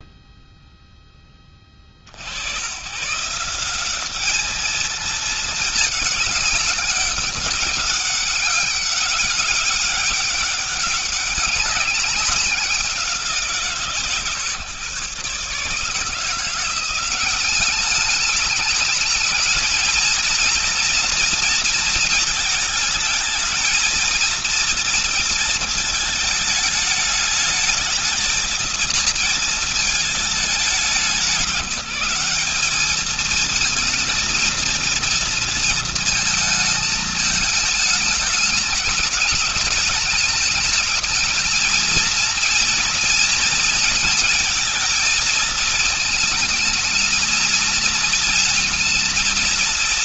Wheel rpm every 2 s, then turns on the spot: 0, 110, 220, 200, 200, 190, 190, 130, 170, 210, 230, 220, 230, 220, 220, 200, 200, 230, 220, 220, 220, 230, 230, 220, 230.
none